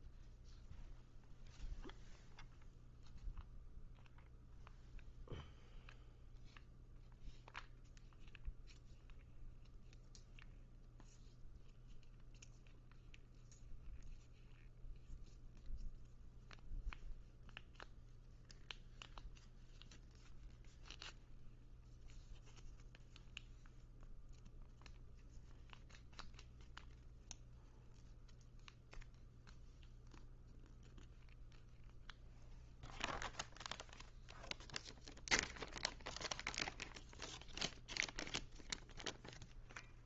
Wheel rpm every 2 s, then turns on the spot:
0, 0, 0, 0, 0, 0, 0, 0, 0, 0, 0, 0, 0, 0, 0, 0, 0, 0, 0, 0.
none